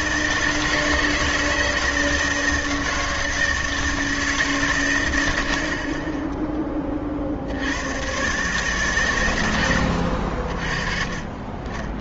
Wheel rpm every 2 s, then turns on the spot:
170, 160, 140, 10, 140, 50.
none